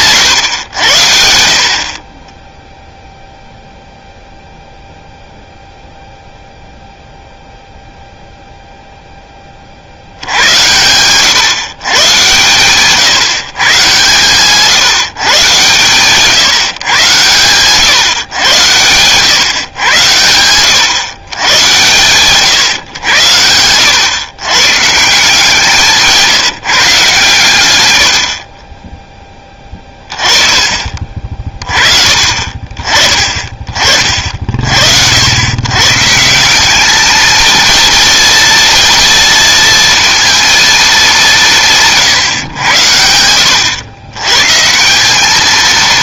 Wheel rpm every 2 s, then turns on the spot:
90, 0, 0, 0, 0, 90, 130, 160, 130, 120, 120, 110, 140, 150, 20, 30, 40, 60, 200, 230, 220, 100, 170.
none